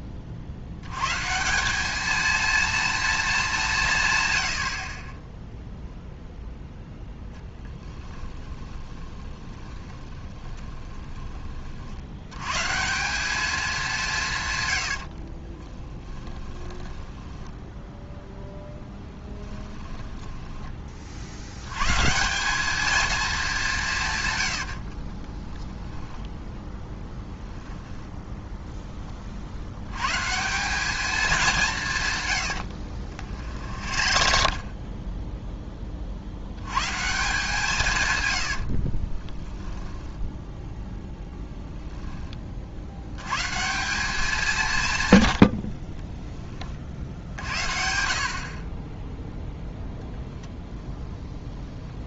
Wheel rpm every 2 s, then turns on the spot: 90, 230, 40, 10, 20, 20, 170, 80, 10, 10, 50, 220, 40, 10, 10, 200, 80, 30, 140, 40, 10, 80, 130, 40, 10, 0.
8-12 14-20 24-28 32-36 38-40